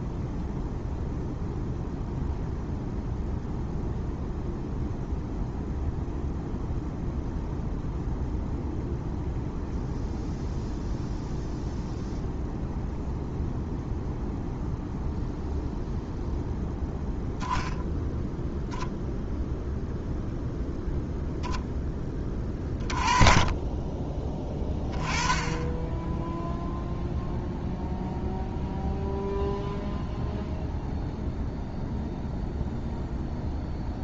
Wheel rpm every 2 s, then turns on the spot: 0, 0, 0, 0, 0, 0, 0, 0, 0, 0, 0, 20, 20, 0, 0, 0, 0.
none